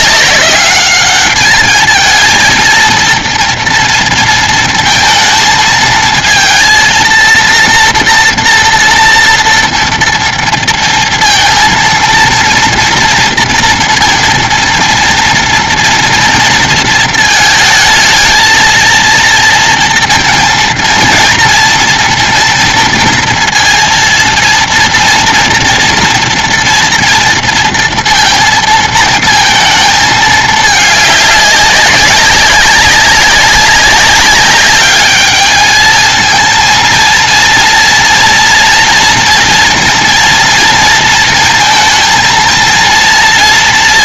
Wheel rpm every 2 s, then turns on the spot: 200, 230, 230, 230, 230, 230, 230, 230, 230, 220, 230, 230, 230, 230, 230, 220, 190, 200, 220, 240, 230, 230.
none